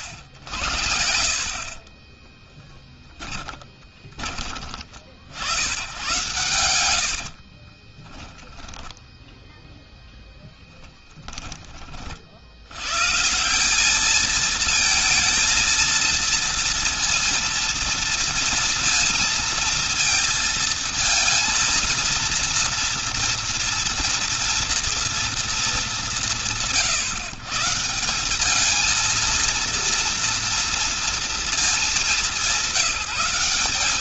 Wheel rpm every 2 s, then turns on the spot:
50, 10, 30, 100, 10, 0, 60, 220, 230, 230, 230, 230, 230, 190, 190, 230, 200.
2-4 6-10